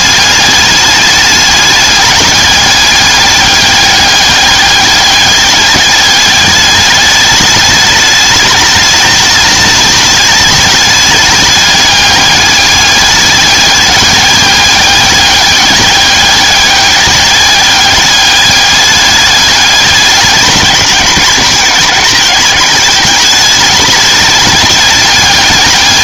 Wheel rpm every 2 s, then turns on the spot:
210, 200, 200, 200, 210, 210, 200, 200, 200, 210, 200, 200, 210.
none